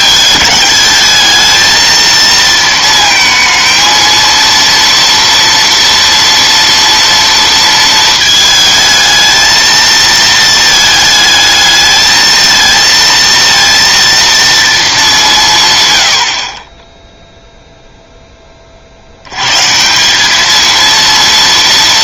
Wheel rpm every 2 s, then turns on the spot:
210, 230, 230, 230, 220, 220, 220, 230, 30, 20, 220.
none